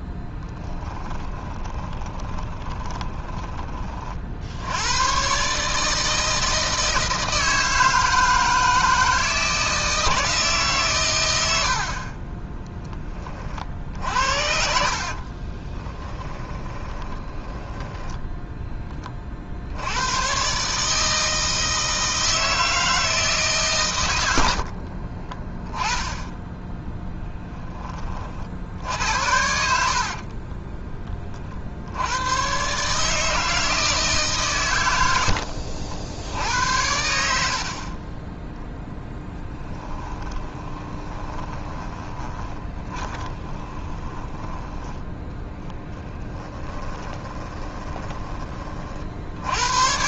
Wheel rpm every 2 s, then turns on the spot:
20, 20, 100, 160, 160, 120, 10, 50, 20, 20, 150, 160, 40, 10, 70, 20, 150, 100, 80, 0, 20, 20, 10, 20, 50.
0-4 14-18 24-26 40-44 46-48